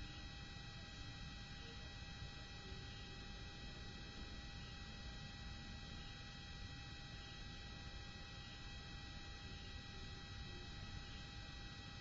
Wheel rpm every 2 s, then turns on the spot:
0, 0, 0, 0, 0, 0.
none